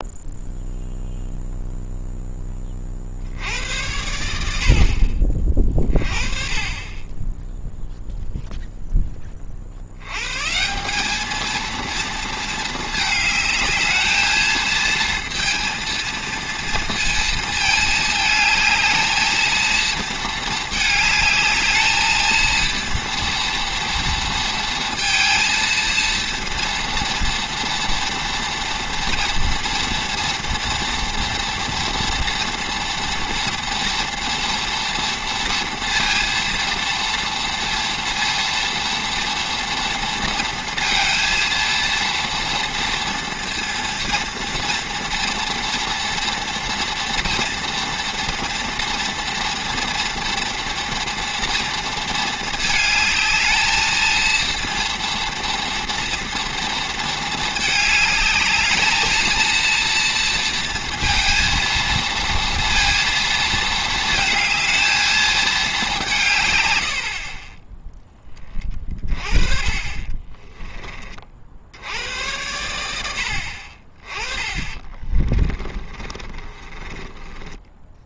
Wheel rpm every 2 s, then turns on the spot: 0, 50, 40, 20, 10, 200, 220, 230, 230, 220, 220, 230, 230, 230, 230, 230, 230, 240, 230, 230, 230, 230, 230, 230, 230, 230, 220, 230, 230, 220, 230, 230, 220, 80, 30, 30, 90, 30, 20.
66-68 74-78